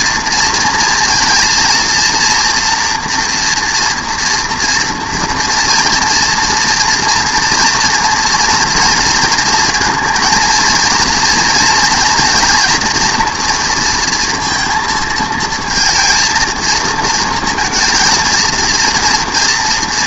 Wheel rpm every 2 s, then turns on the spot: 230, 230, 240, 230, 240, 230, 230, 230, 230, 230.
none